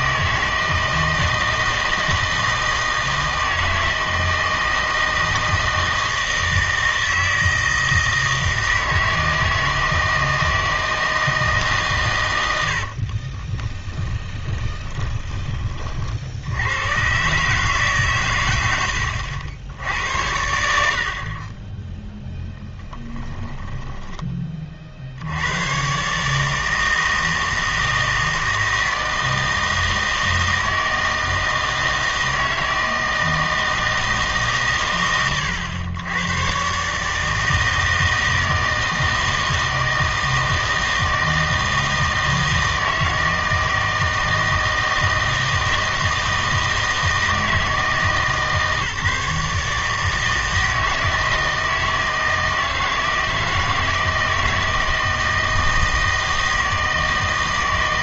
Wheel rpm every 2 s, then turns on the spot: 160, 160, 160, 160, 160, 160, 90, 20, 90, 100, 80, 10, 40, 160, 160, 160, 160, 130, 130, 160, 160, 160, 160, 160, 150, 160, 160, 160, 160.
14-16